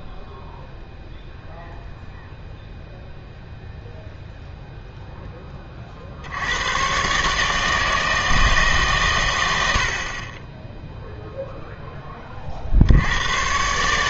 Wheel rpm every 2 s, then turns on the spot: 0, 0, 0, 100, 150, 10, 60.
none